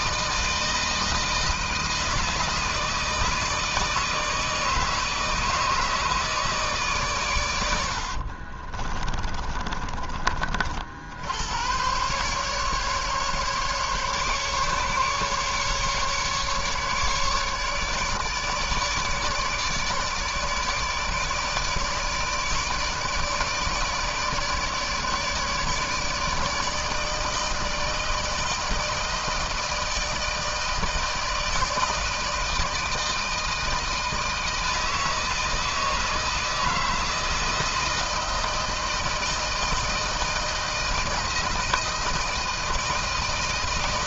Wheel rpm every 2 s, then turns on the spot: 160, 160, 160, 160, 50, 60, 140, 140, 150, 150, 150, 150, 150, 150, 160, 160, 160, 160, 160, 160, 160, 160.
8-10